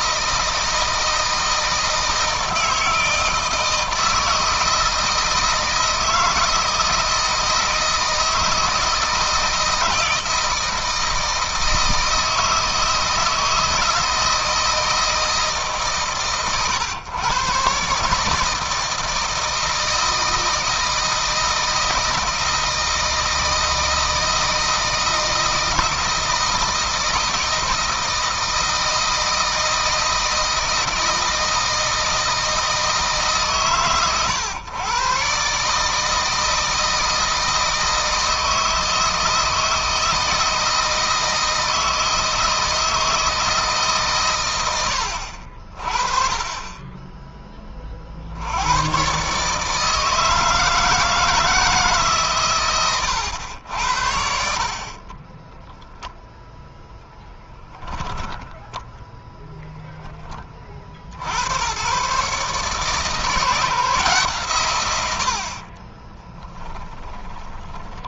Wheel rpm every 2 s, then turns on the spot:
160, 160, 160, 160, 160, 160, 160, 160, 130, 160, 160, 160, 160, 160, 160, 160, 160, 120, 160, 160, 160, 160, 110, 30, 90, 160, 120, 50, 0, 0, 40, 150, 120, 20.
54-56 64-68